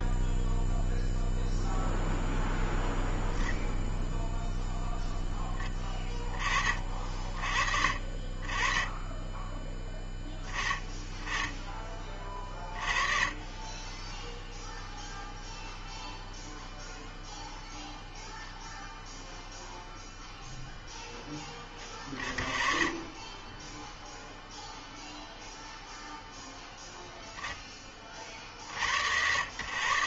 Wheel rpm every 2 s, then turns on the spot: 0, 0, 0, 30, 40, 20, 30, 0, 0, 0, 0, 20, 0, 0, 50.
none